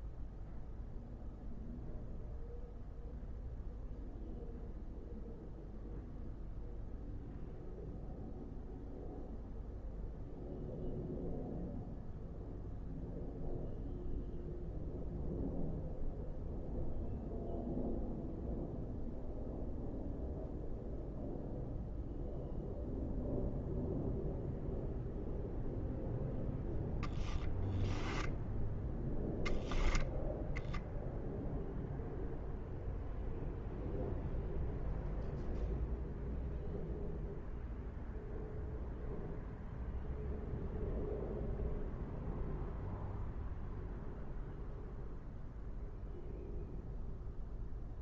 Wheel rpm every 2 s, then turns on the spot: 0, 0, 0, 0, 0, 0, 0, 0, 0, 0, 0, 0, 0, 0, 0, 0, 0, 0, 0, 0, 0, 0, 0, 0.
none